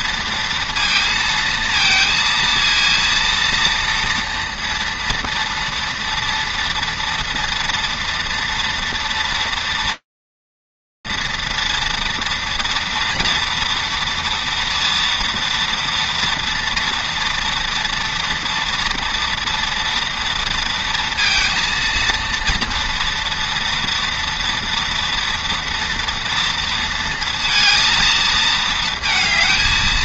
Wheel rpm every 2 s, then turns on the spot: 230, 230, 230, 230, 230, 230, 230, 230, 230, 230, 230, 230, 230, 230, 220.
none